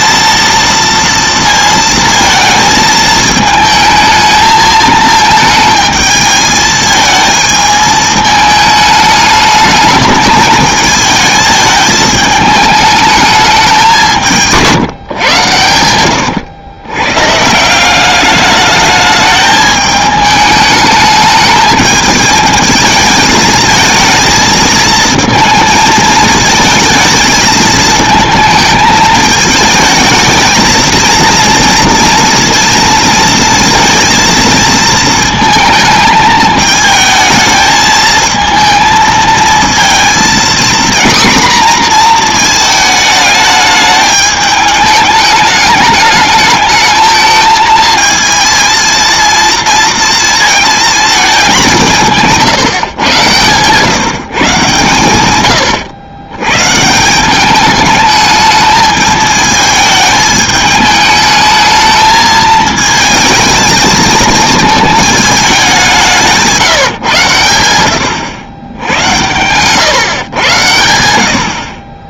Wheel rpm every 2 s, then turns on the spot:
230, 220, 220, 220, 220, 220, 210, 160, 110, 210, 210, 220, 220, 220, 220, 230, 230, 230, 220, 220, 240, 220, 210, 220, 230, 220, 150, 140, 140, 220, 210, 220, 220, 160, 90, 100.
none